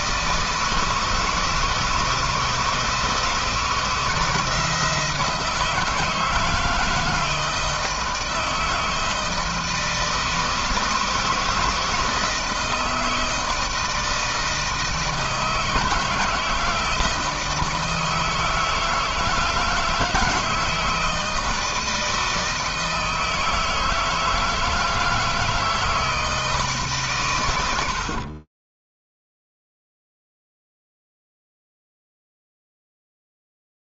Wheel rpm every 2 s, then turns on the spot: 160, 160, 170, 160, 160, 160, 160, 160, 160, 160, 160, 160, 160, 130, 0, 0, 0.
none